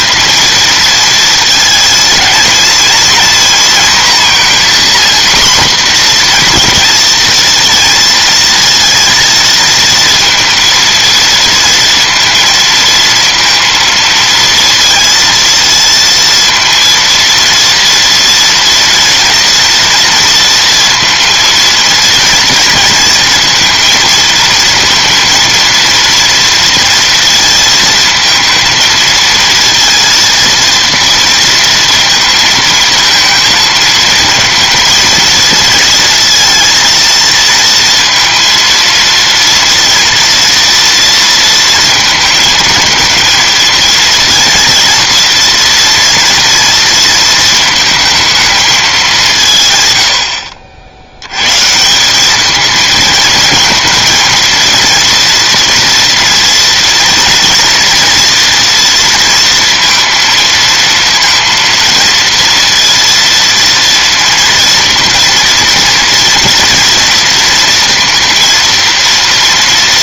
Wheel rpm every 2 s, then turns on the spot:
230, 230, 250, 240, 230, 230, 230, 230, 230, 230, 230, 230, 230, 230, 230, 230, 220, 230, 230, 230, 230, 230, 230, 230, 220, 70, 210, 230, 230, 240, 230, 230, 230, 230, 230.
none